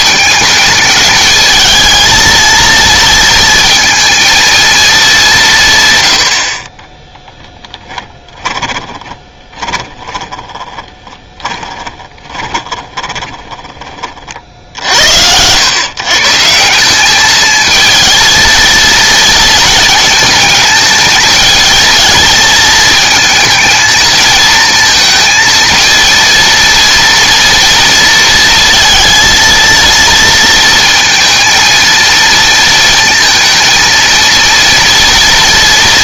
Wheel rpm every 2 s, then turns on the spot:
210, 230, 230, 50, 10, 20, 20, 60, 180, 230, 220, 220, 220, 230, 230, 230, 230, 230.
8-14